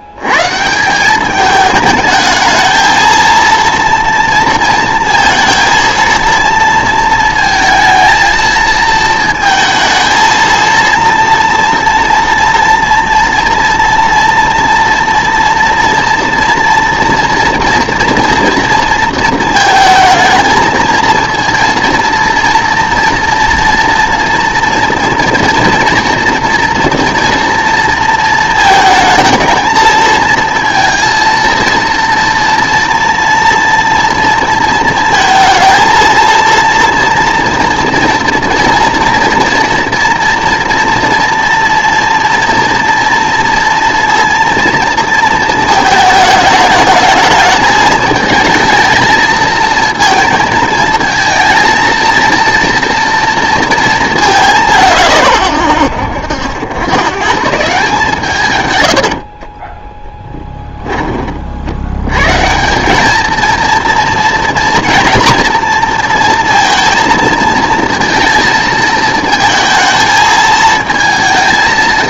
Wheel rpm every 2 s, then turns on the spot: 160, 220, 220, 230, 220, 230, 230, 230, 230, 230, 220, 230, 240, 230, 220, 230, 230, 230, 230, 230, 230, 230, 230, 220, 220, 220, 240, 170, 110, 110, 20, 180, 240, 230, 220, 220.
58-60